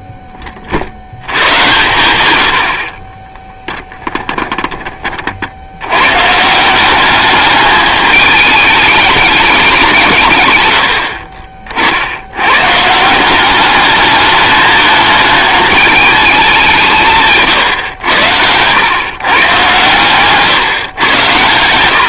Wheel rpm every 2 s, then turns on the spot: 30, 70, 10, 170, 210, 100, 110, 210, 190, 110, 130.
none